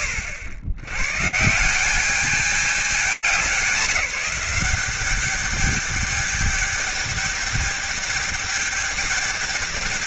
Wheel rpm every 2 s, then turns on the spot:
90, 210, 200, 210, 210.
none